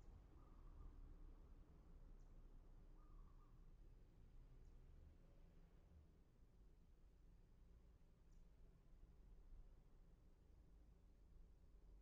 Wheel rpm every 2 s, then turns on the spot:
0, 0, 0, 0, 0, 0.
none